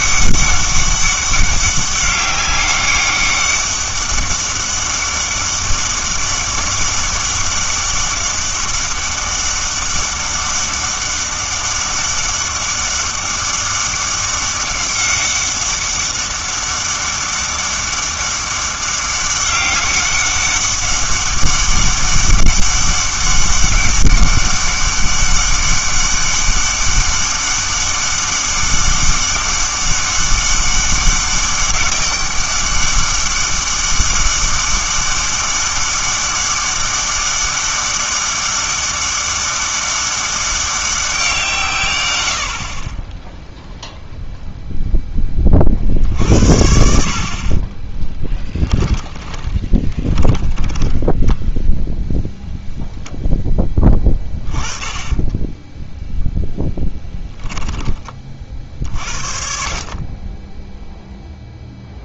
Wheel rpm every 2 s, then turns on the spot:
200, 200, 200, 200, 200, 200, 200, 200, 200, 200, 200, 200, 200, 200, 200, 200, 200, 200, 200, 200, 200, 50, 0, 60, 10, 10, 0, 20, 0, 50, 10.
48-52 54-56